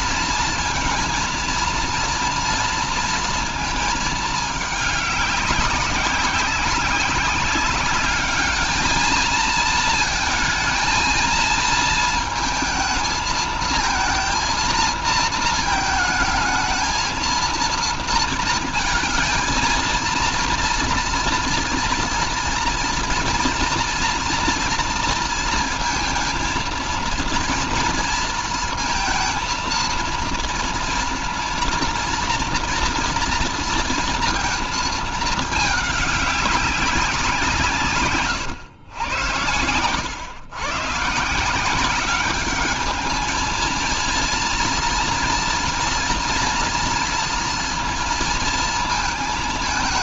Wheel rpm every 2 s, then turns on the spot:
230, 230, 210, 190, 220, 220, 220, 230, 220, 220, 230, 230, 230, 230, 230, 230, 230, 220, 190, 110, 140, 210, 230, 240, 220.
none